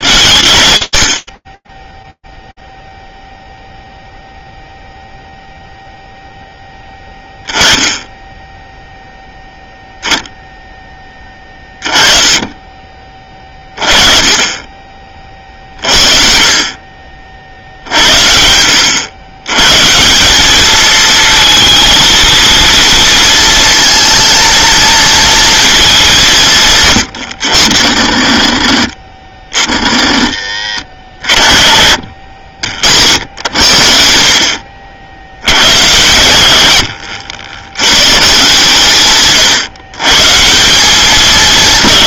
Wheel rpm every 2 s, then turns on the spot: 100, 0, 0, 10, 0, 10, 30, 30, 40, 90, 220, 230, 230, 150, 100, 90, 70, 60, 90, 150, 190.
26-28